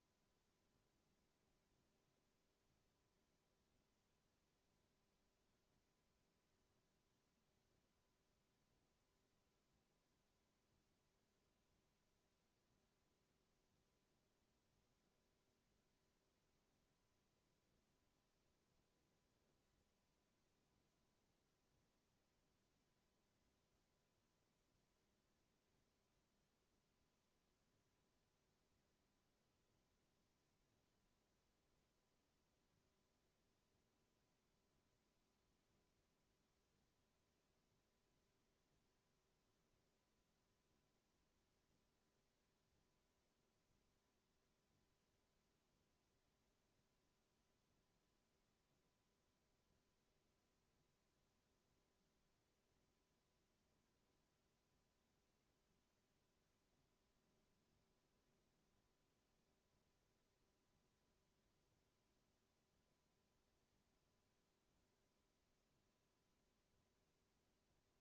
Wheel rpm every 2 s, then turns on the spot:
0, 0, 0, 0, 0, 0, 0, 0, 0, 0, 0, 0, 0, 0, 0, 0, 0, 0, 0, 0, 0, 0, 0, 0, 0, 0, 0, 0, 0, 0, 0, 0, 0, 0.
none